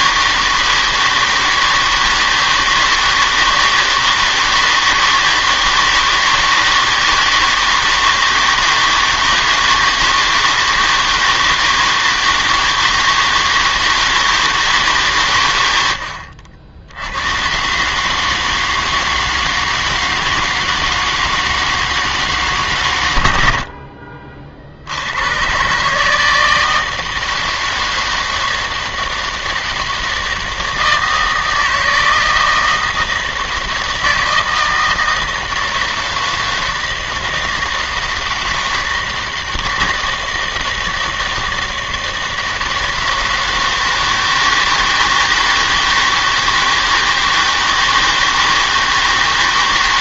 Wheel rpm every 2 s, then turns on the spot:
160, 160, 160, 160, 160, 160, 160, 160, 70, 160, 160, 130, 60, 160, 160, 160, 160, 160, 160, 160, 160, 160, 160, 160, 160.
none